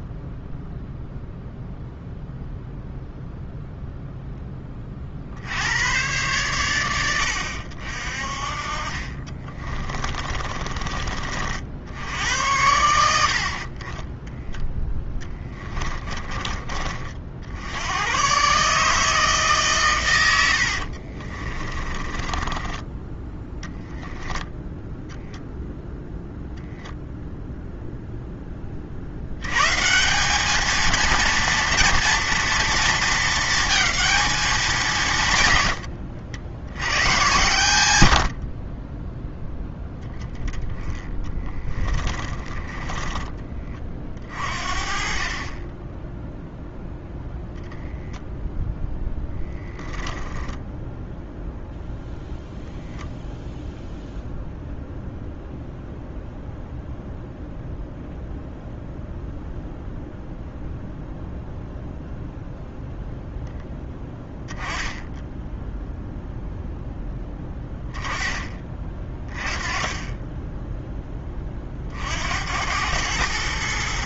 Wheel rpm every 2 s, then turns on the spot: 0, 0, 30, 110, 40, 30, 90, 10, 20, 150, 70, 10, 0, 0, 40, 230, 230, 170, 90, 20, 10, 20, 40, 0, 0, 0, 0, 0, 0, 0, 0, 0, 0, 0, 20, 10, 100.
14-16 20-24 42-44